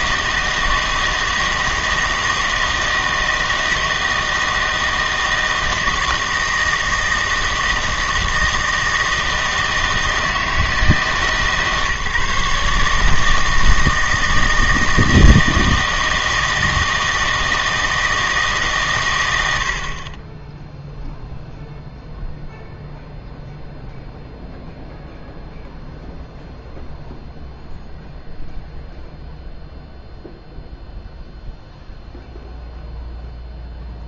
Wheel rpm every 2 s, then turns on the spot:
160, 160, 160, 160, 160, 160, 150, 160, 160, 140, 0, 0, 0, 0, 0, 0, 0.
none